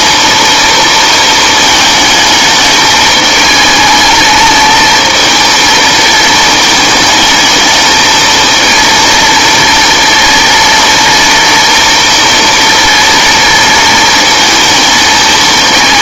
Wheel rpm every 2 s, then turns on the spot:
230, 210, 220, 220, 230, 230, 230, 220.
none